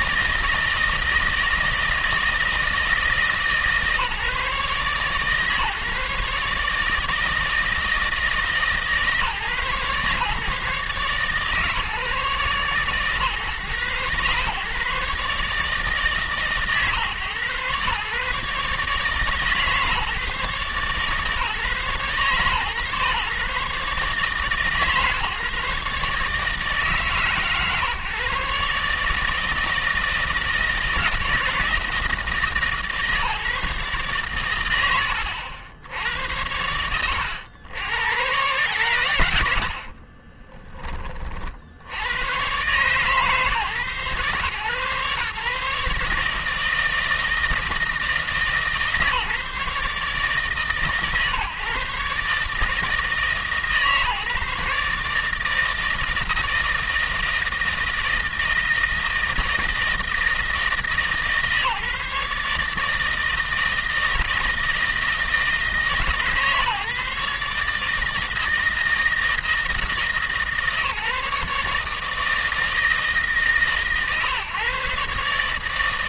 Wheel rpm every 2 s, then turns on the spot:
160, 160, 140, 150, 150, 140, 130, 140, 140, 140, 140, 140, 150, 150, 140, 160, 150, 90, 80, 110, 20, 130, 130, 160, 150, 140, 150, 150, 160, 160, 160, 150, 160, 140, 160, 150, 150, 130.
none